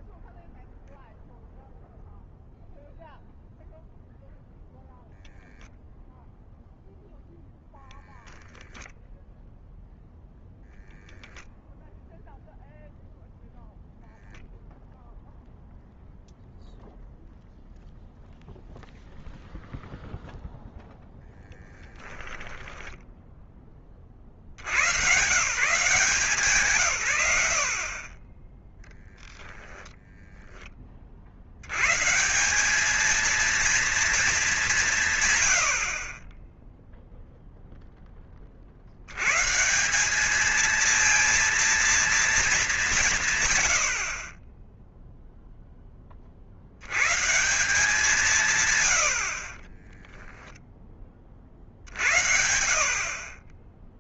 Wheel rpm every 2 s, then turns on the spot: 0, 0, 0, 0, 0, 0, 0, 0, 0, 0, 10, 20, 130, 70, 10, 90, 230, 90, 0, 110, 230, 140, 0, 130, 70, 40, 30.
20-22 48-50